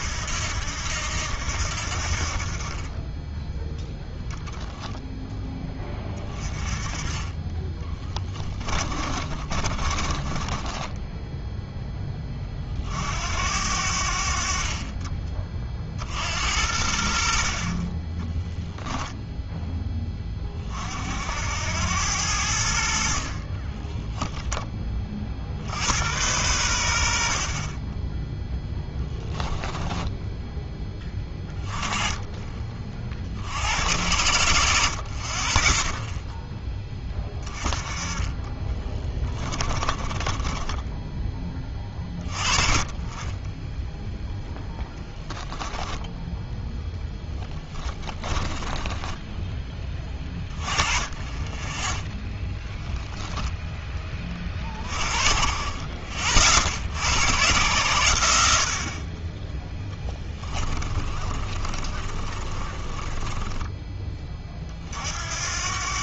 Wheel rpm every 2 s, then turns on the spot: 80, 30, 10, 20, 20, 20, 50, 40, 70, 0, 50, 70, 20, 80, 10, 10, 30, 70, 10, 20, 10, 20, 0, 10, 20, 20, 10, 40, 60, 50, 20, 30, 50.
8-12 28-30 38-42 48-50 52-54 60-64